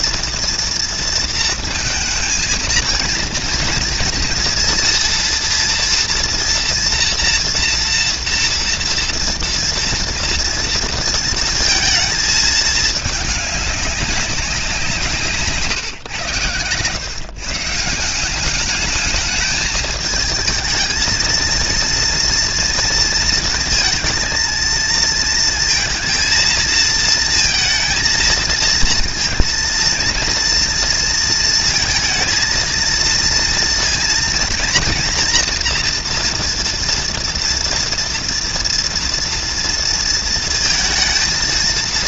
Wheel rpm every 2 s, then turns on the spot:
230, 230, 230, 240, 240, 230, 210, 170, 120, 210, 220, 230, 230, 220, 230, 230, 230, 230, 230, 230, 230.
none